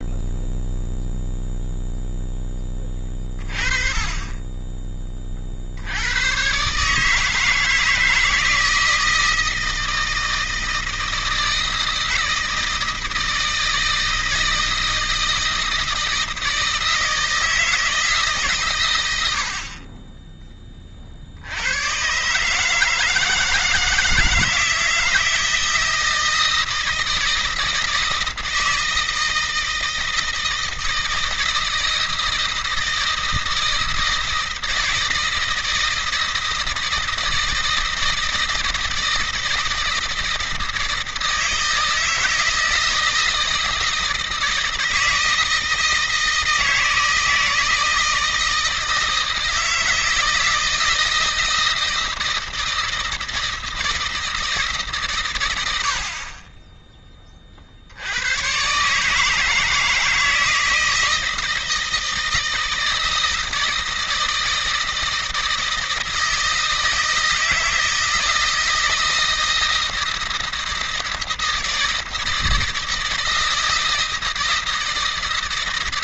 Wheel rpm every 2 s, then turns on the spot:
0, 20, 20, 130, 160, 160, 160, 160, 160, 120, 30, 150, 160, 160, 160, 160, 160, 160, 160, 160, 160, 160, 160, 160, 160, 160, 160, 150, 30, 130, 160, 160, 160, 160, 160, 160, 160, 160.
none